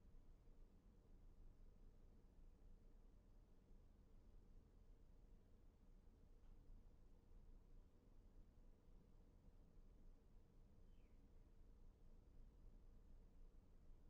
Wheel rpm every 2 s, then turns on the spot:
0, 0, 0, 0, 0, 0, 0.
none